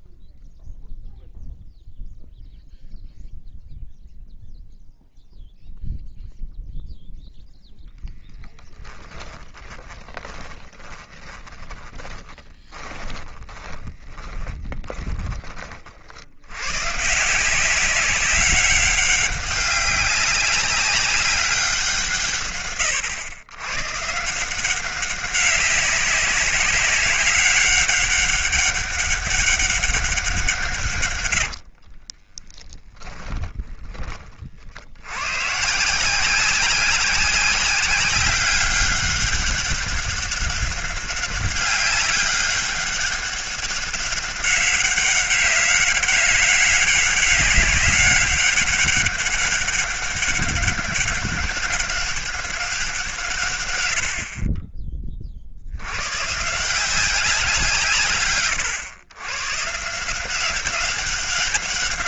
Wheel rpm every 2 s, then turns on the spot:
0, 0, 0, 0, 20, 20, 20, 20, 110, 190, 190, 120, 180, 190, 200, 140, 10, 60, 190, 200, 200, 200, 200, 200, 200, 200, 180, 30, 170, 120, 190.
8-16 32-34